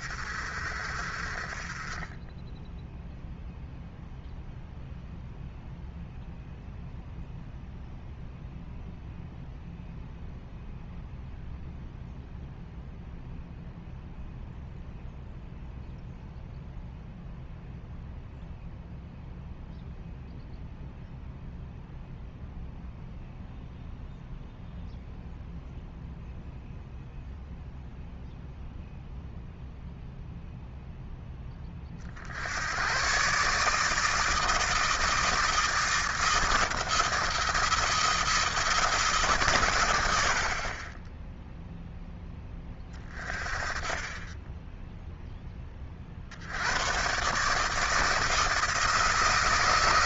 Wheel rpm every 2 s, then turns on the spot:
50, 10, 0, 0, 0, 0, 0, 0, 0, 0, 0, 0, 0, 0, 0, 0, 80, 160, 170, 170, 40, 20, 10, 80, 160.
44-46